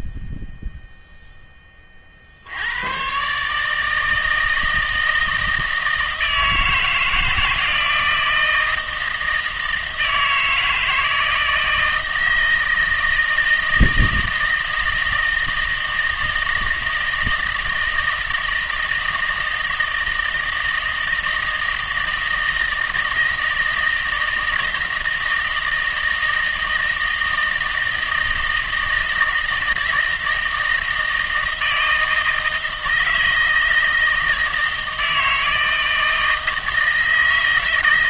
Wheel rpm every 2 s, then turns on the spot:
0, 90, 160, 160, 160, 160, 160, 160, 160, 160, 160, 160, 160, 160, 160, 160, 160, 160, 160.
none